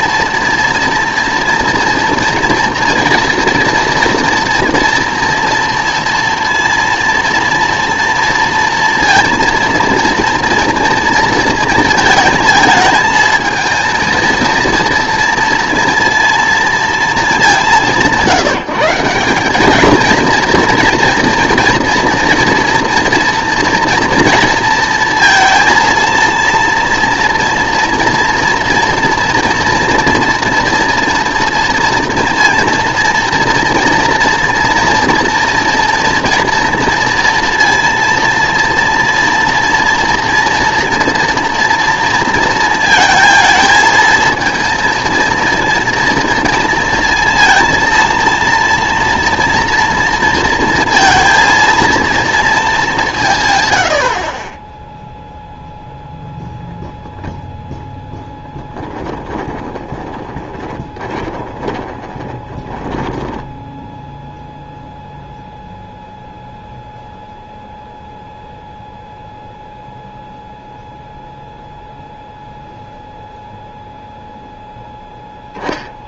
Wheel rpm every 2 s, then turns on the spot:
230, 230, 230, 230, 230, 230, 220, 230, 230, 180, 230, 230, 230, 230, 230, 240, 240, 240, 230, 230, 230, 220, 230, 230, 230, 230, 220, 20, 0, 10, 20, 20, 0, 0, 0, 0, 0, 0.
58-64